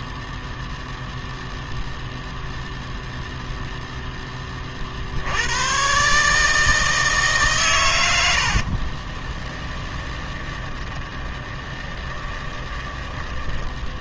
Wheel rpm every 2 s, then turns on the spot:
0, 0, 10, 150, 80, 20, 20.
8-14